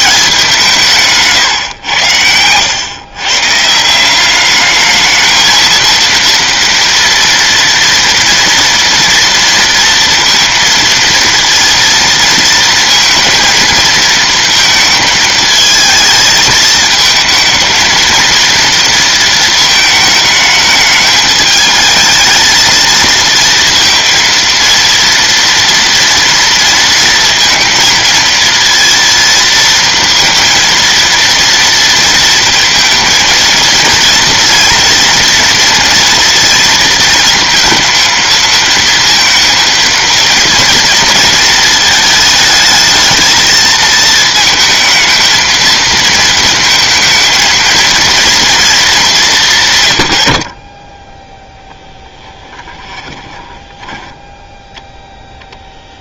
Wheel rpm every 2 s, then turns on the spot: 170, 100, 200, 230, 230, 230, 230, 230, 220, 230, 210, 220, 230, 230, 230, 230, 230, 230, 230, 230, 230, 220, 220, 230, 230, 50, 10, 0.
52-54